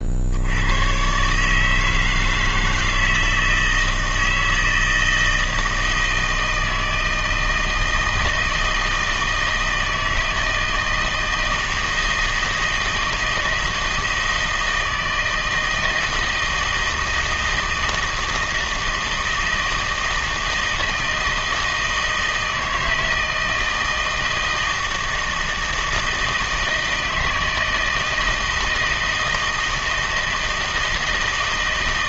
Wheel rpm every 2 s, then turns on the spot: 100, 160, 160, 160, 160, 160, 160, 160, 160, 160, 160, 160, 160, 160, 160, 160.
none